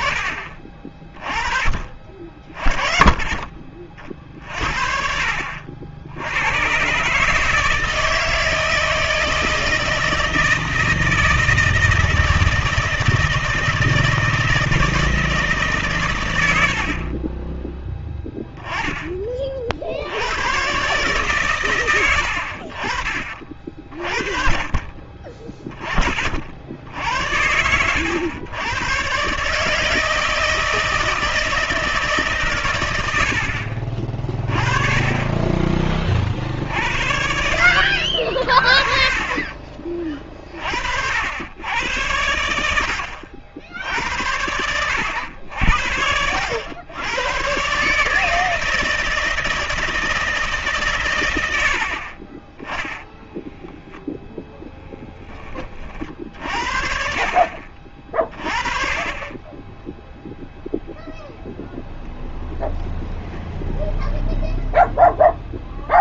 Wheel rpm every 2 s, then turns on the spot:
40, 30, 50, 100, 160, 160, 160, 160, 80, 10, 120, 50, 40, 50, 110, 160, 120, 30, 60, 50, 60, 70, 90, 90, 160, 140, 20, 10, 60, 30, 0, 0, 0.
54-56